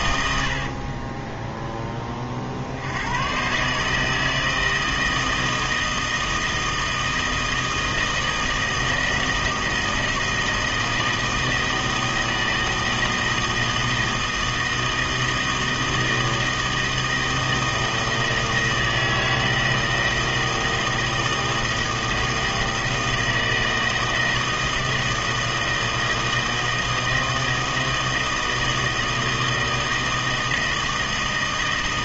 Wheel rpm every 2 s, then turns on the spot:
60, 60, 160, 160, 160, 160, 160, 160, 160, 160, 160, 160, 160, 160, 160, 160.
0-2